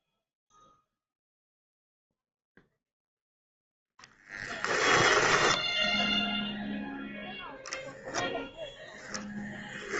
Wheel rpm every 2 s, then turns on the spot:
0, 10, 0, 0, 10.
2-4 8-10